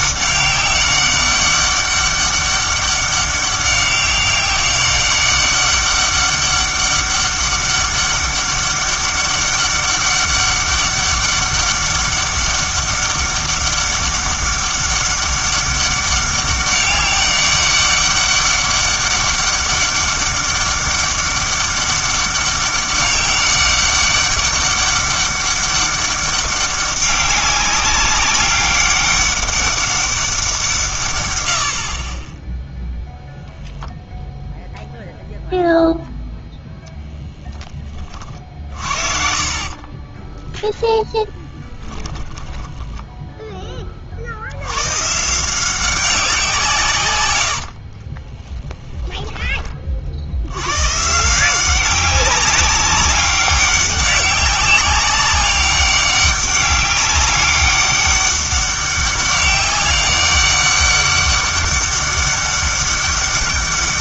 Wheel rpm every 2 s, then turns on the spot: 190, 200, 190, 200, 200, 200, 200, 200, 200, 200, 200, 200, 200, 200, 200, 160, 0, 0, 10, 60, 10, 10, 100, 170, 10, 110, 190, 190, 200, 200, 200, 200.
36-40 42-44 48-50